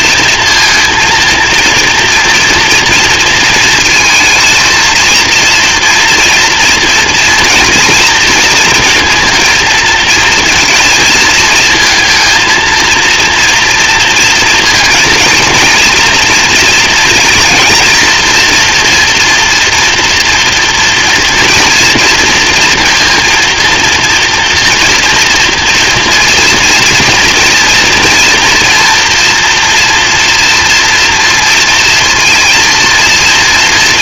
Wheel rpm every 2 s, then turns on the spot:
230, 230, 230, 230, 230, 230, 230, 230, 230, 240, 230, 230, 230, 230, 230, 230, 230.
none